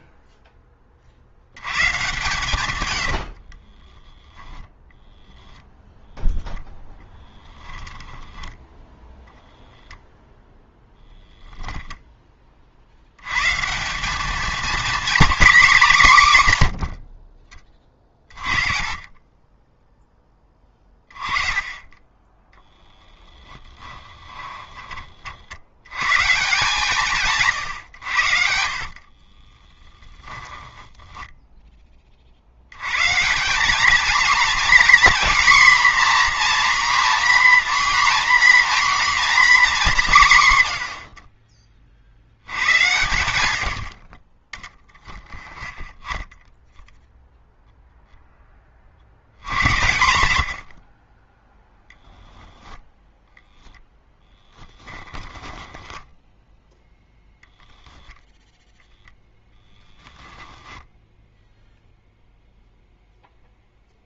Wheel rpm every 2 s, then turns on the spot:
30, 110, 0, 10, 10, 0, 90, 240, 70, 30, 30, 10, 20, 180, 60, 10, 110, 240, 240, 240, 110, 100, 0, 0, 50, 40, 0, 10, 0, 0, 0, 0.
28-32 54-56